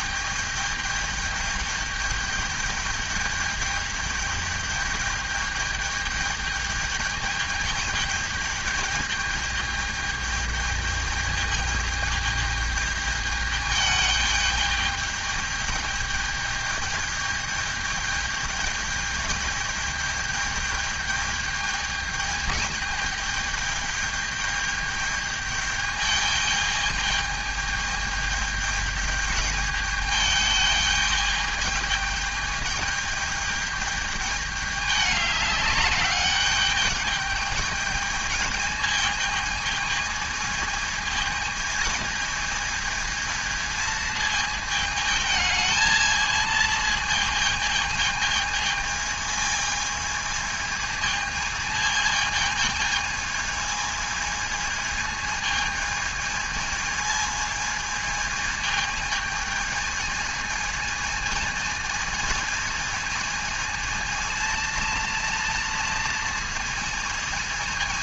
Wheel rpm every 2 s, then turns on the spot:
210, 210, 210, 210, 210, 210, 210, 210, 210, 210, 210, 210, 210, 210, 210, 210, 210, 200, 210, 210, 220, 220, 220, 220, 220, 220, 220, 220, 220, 220, 220, 220, 230, 220.
none